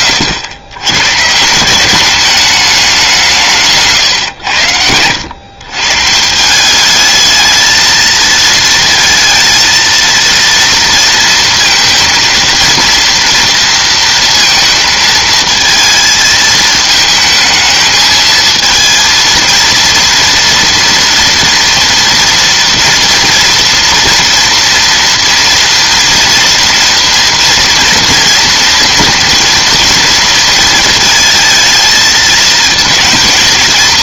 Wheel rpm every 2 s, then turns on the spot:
110, 200, 100, 190, 230, 230, 230, 230, 220, 220, 230, 240, 230, 230, 230, 230, 220.
none